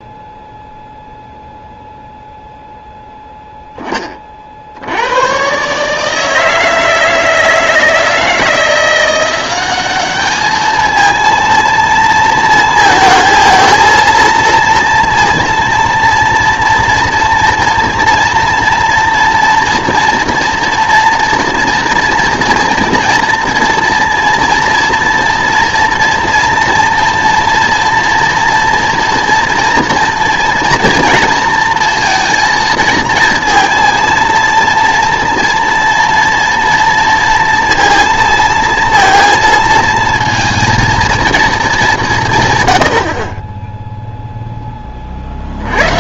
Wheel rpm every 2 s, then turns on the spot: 0, 0, 60, 160, 170, 220, 220, 230, 230, 230, 240, 230, 230, 230, 230, 230, 220, 230, 230, 230, 230, 120, 10.
none